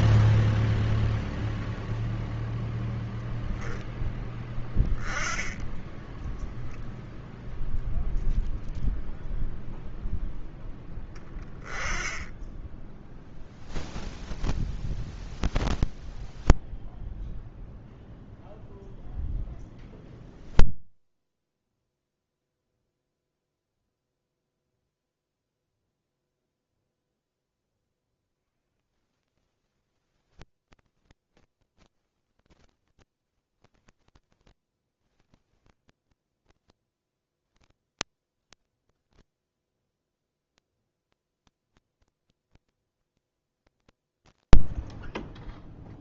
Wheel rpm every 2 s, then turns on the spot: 0, 0, 10, 10, 0, 0, 10, 0, 0, 0, 0, 0, 0, 0, 10, 0, 0, 0, 10, 0, 0, 0, 0.
none